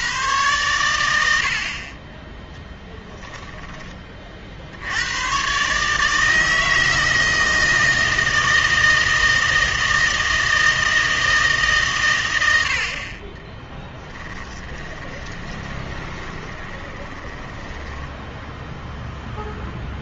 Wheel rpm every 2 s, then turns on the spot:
110, 10, 60, 160, 160, 160, 80, 10, 20, 0.
2-4 14-18